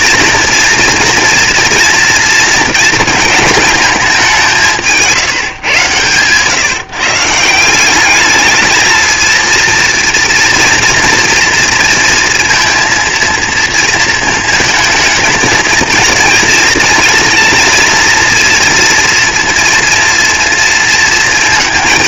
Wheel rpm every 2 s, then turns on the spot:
240, 230, 180, 150, 220, 230, 230, 230, 220, 230, 230.
none